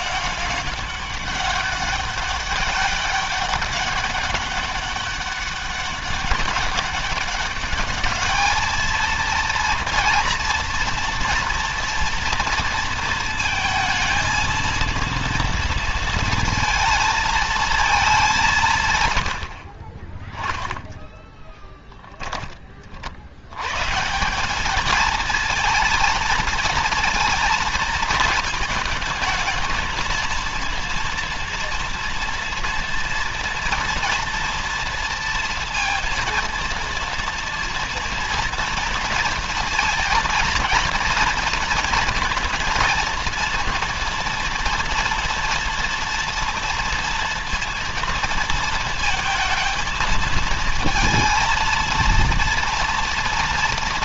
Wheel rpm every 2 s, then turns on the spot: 200, 200, 200, 200, 230, 230, 230, 230, 220, 120, 10, 50, 220, 230, 220, 230, 230, 230, 230, 230, 230, 230, 230, 230, 220, 230, 230.
20-22